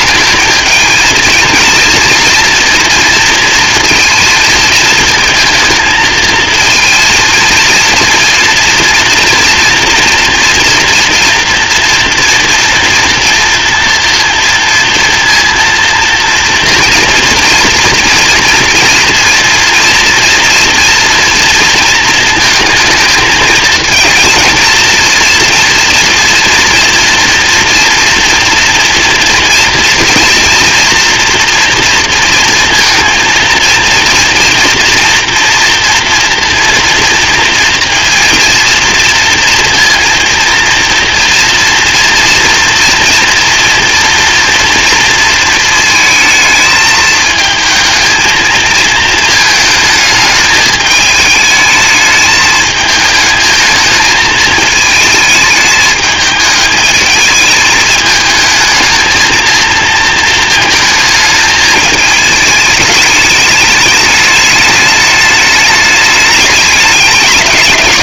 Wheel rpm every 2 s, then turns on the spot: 220, 230, 220, 230, 230, 230, 230, 230, 230, 230, 240, 230, 230, 240, 230, 230, 230, 240, 240, 230, 230, 230, 230, 220, 220, 210, 210, 220, 220, 220, 220, 220, 210, 210.
none